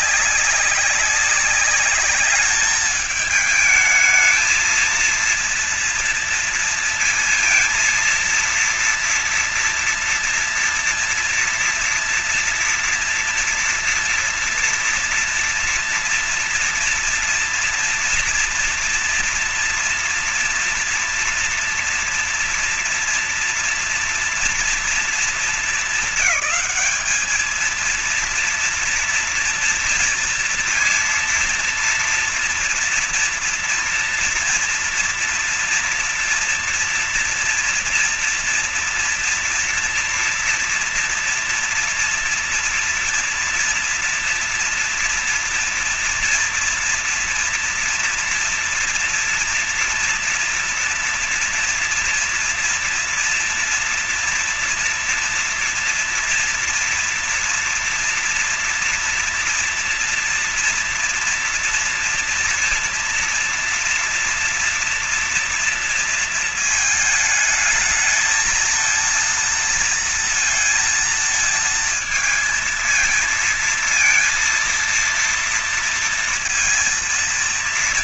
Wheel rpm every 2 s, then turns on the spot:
200, 200, 220, 230, 230, 230, 230, 240, 230, 230, 230, 230, 230, 200, 230, 230, 230, 230, 230, 240, 230, 230, 230, 230, 230, 230, 230, 230, 240, 230, 230, 230, 230, 230, 220, 230, 230, 230, 230.
none